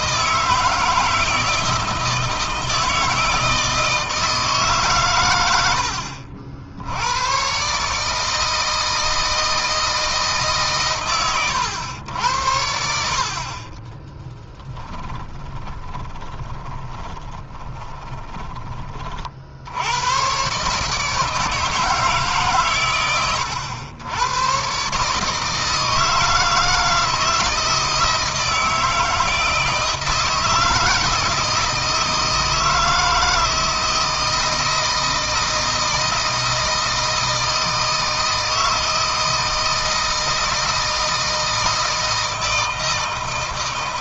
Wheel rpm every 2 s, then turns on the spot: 160, 160, 140, 90, 160, 130, 60, 10, 20, 30, 140, 120, 140, 160, 160, 160, 160, 160, 160, 160, 160, 160.
14-18